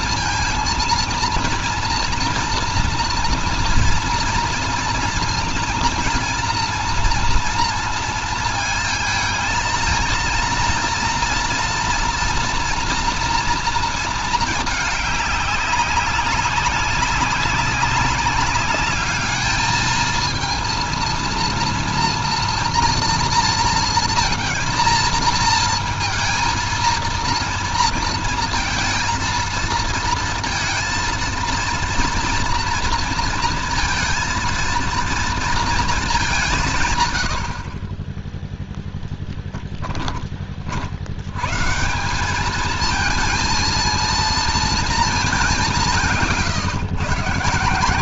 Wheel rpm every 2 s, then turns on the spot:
230, 230, 230, 240, 230, 230, 230, 210, 200, 210, 220, 230, 230, 230, 230, 230, 230, 230, 150, 0, 40, 210, 230, 110.
none